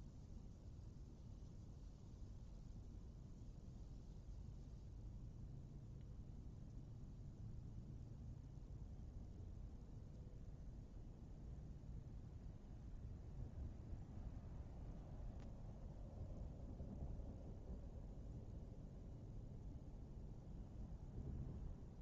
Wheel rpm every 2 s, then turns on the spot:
0, 0, 0, 0, 0, 0, 0, 0, 0, 0, 0.
none